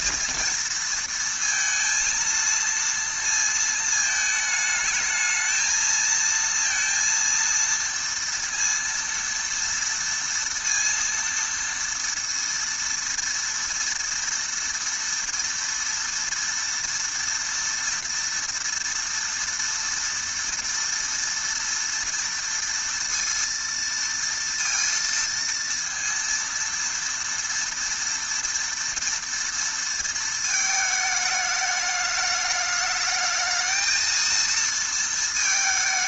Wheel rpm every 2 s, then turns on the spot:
230, 230, 210, 230, 230, 230, 230, 230, 230, 230, 230, 230, 230, 230, 230, 220, 210, 230.
none